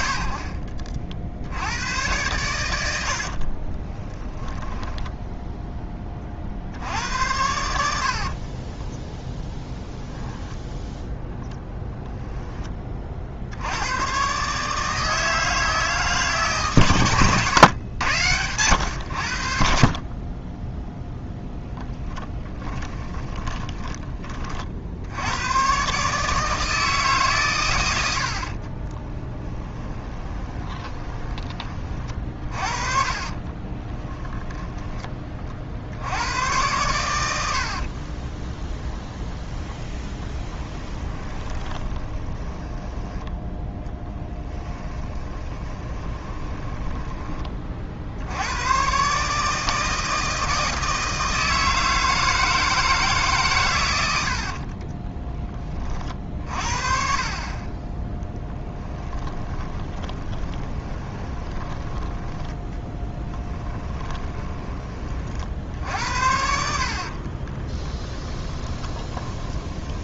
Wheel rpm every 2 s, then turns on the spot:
60, 80, 10, 60, 20, 0, 20, 150, 130, 90, 10, 20, 60, 160, 40, 20, 40, 10, 110, 10, 20, 10, 10, 10, 120, 160, 160, 20, 40, 10, 20, 10, 30, 60, 20.
8-10 22-24 28-34 38-48 54-56 58-64 68-70